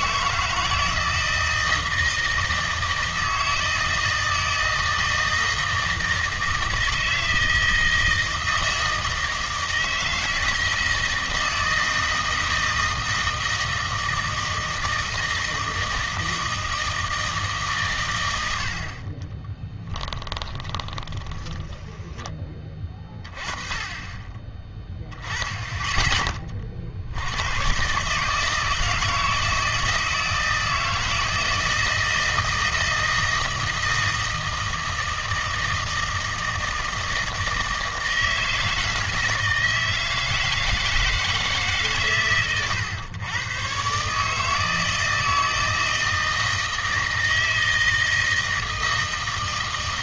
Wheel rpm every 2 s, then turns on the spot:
160, 160, 160, 160, 160, 160, 160, 160, 160, 70, 10, 20, 20, 30, 160, 160, 160, 160, 160, 160, 160, 120, 160, 160, 160.
20-22